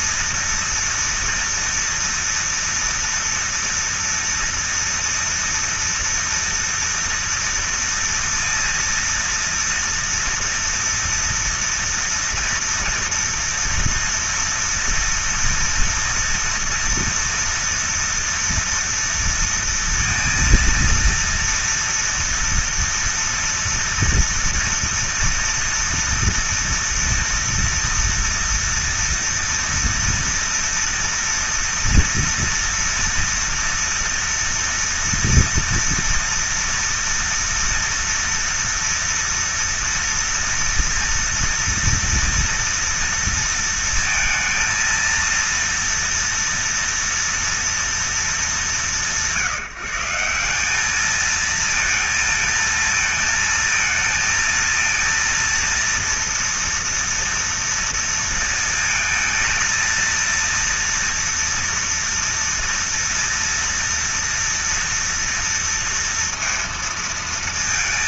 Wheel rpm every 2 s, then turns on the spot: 240, 240, 230, 230, 230, 230, 230, 230, 230, 230, 230, 230, 230, 230, 230, 230, 230, 230, 230, 230, 230, 230, 230, 230, 210, 170, 230, 230, 240, 230, 230, 230, 230, 230.
none